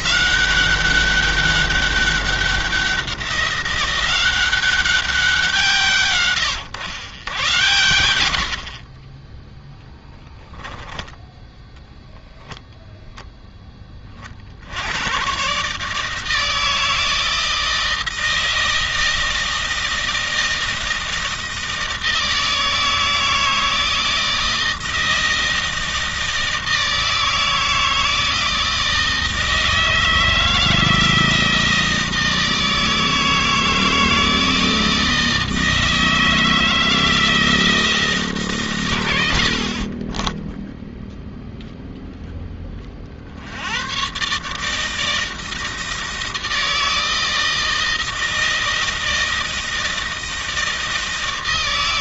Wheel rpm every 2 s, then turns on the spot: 190, 190, 190, 110, 50, 20, 10, 50, 160, 160, 160, 160, 160, 160, 160, 160, 160, 160, 160, 130, 0, 20, 140, 160, 160, 160.
8-10